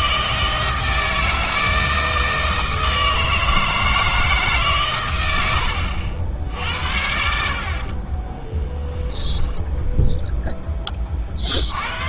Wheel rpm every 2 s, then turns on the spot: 160, 160, 140, 80, 10, 10.
8-10